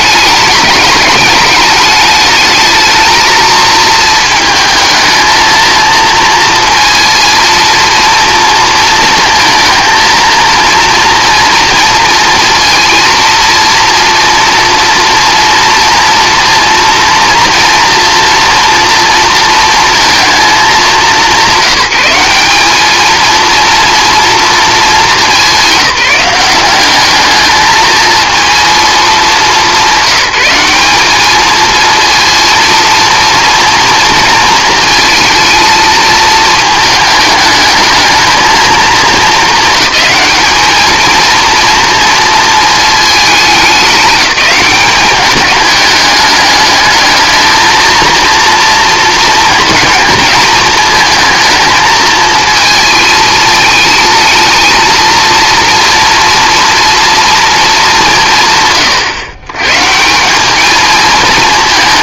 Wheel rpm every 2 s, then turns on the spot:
210, 220, 220, 230, 230, 230, 230, 230, 230, 230, 210, 210, 220, 190, 220, 200, 230, 230, 220, 220, 220, 220, 200, 210, 230, 220, 220, 230, 240, 140, 210.
none